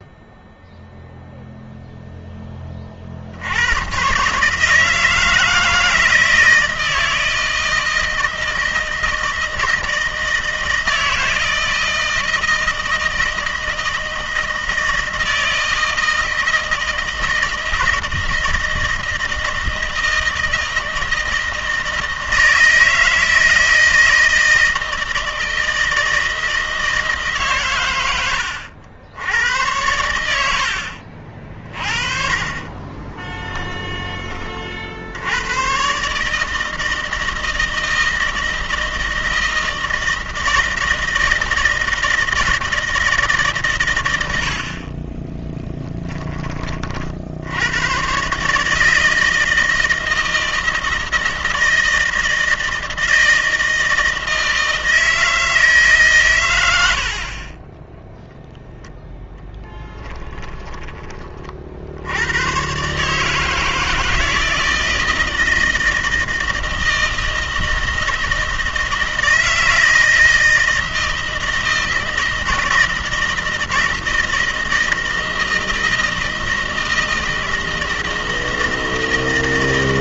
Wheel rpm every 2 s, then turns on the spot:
0, 30, 150, 170, 160, 160, 160, 160, 160, 160, 160, 160, 160, 160, 90, 70, 30, 60, 160, 160, 160, 160, 40, 50, 160, 160, 160, 160, 100, 0, 20, 130, 170, 160, 160, 160, 160, 160, 160, 160.
30-34 44-46